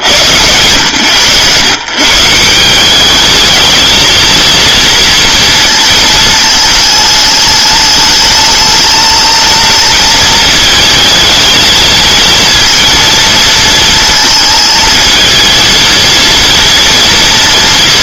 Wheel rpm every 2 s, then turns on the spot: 120, 190, 230, 210, 220, 220, 230, 220, 230.
none